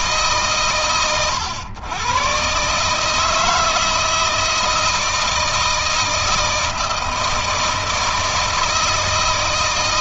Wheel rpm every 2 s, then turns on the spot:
110, 150, 160, 160, 160.
none